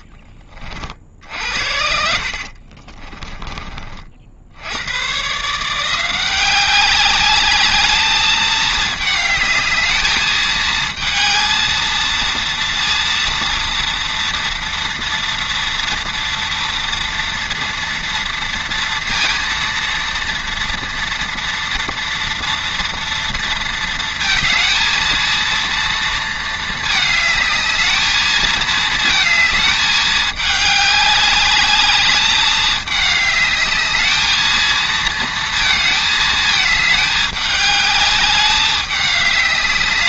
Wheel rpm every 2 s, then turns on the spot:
30, 40, 90, 190, 220, 220, 230, 230, 230, 230, 230, 240, 220, 220, 220, 210, 210, 220, 220, 200.
2-4